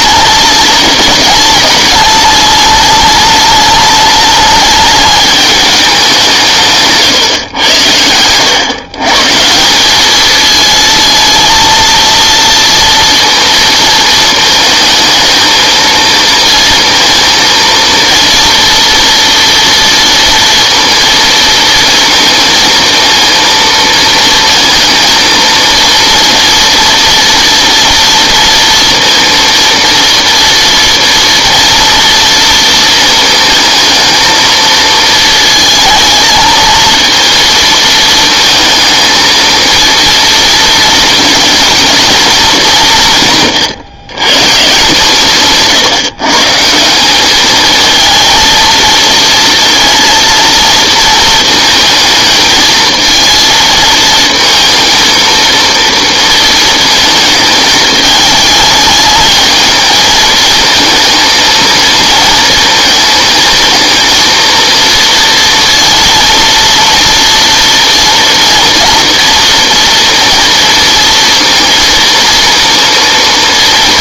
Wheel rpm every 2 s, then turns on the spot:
200, 210, 210, 170, 120, 220, 230, 220, 230, 230, 230, 230, 230, 230, 230, 230, 230, 220, 220, 220, 230, 210, 150, 160, 230, 230, 220, 220, 230, 210, 220, 230, 230, 230, 230, 230, 230.
none